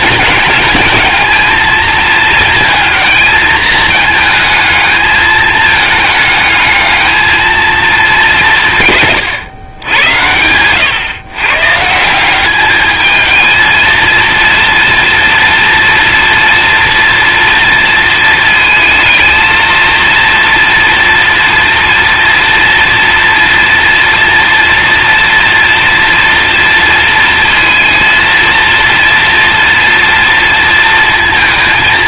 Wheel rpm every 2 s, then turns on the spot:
210, 230, 220, 220, 150, 110, 210, 230, 240, 220, 230, 230, 230, 230, 230, 230.
none